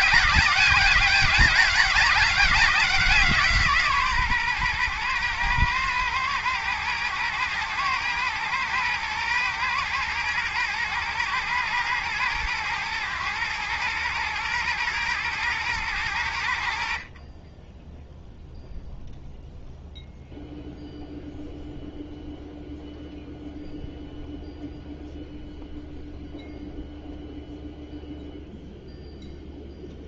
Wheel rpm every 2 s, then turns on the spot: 190, 190, 130, 110, 120, 120, 110, 120, 80, 0, 0, 0, 0, 0, 0.
none